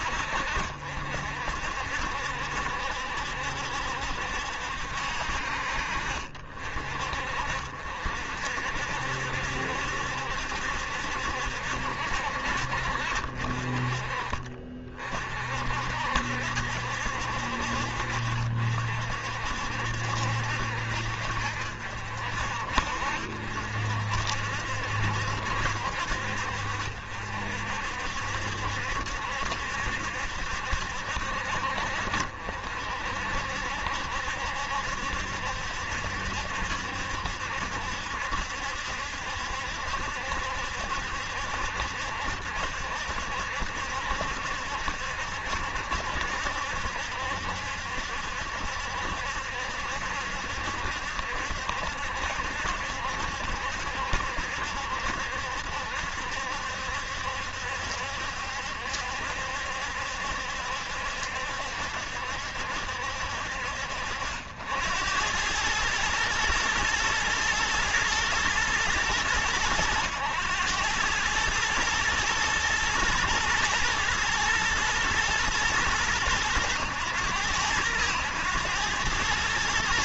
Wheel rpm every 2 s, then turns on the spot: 60, 70, 60, 50, 70, 70, 50, 40, 70, 60, 60, 60, 60, 60, 70, 60, 60, 70, 70, 70, 70, 70, 70, 70, 70, 70, 70, 70, 70, 70, 70, 60, 90, 110, 110, 110, 110, 110, 100, 100.
none